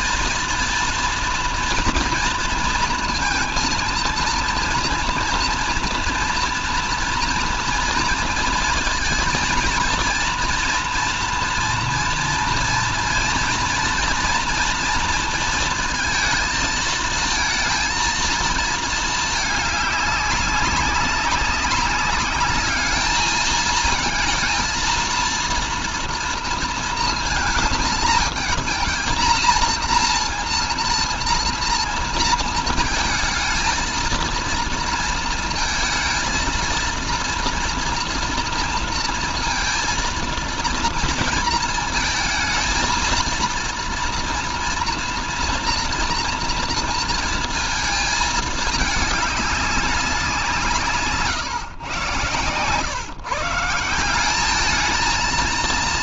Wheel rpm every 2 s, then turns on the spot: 230, 230, 230, 230, 230, 230, 230, 230, 220, 220, 200, 210, 230, 230, 230, 230, 230, 230, 230, 230, 230, 230, 230, 230, 210, 170, 120, 210.
none